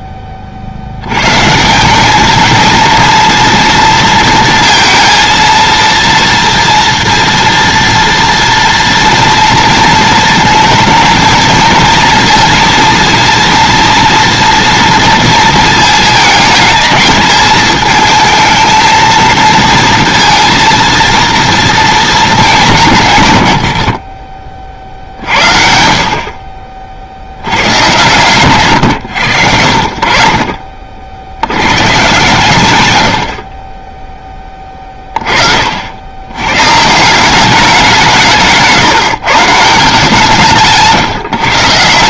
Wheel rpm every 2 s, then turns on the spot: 40, 220, 230, 230, 230, 220, 230, 240, 220, 220, 230, 200, 40, 40, 120, 50, 130, 10, 140, 160, 170.
none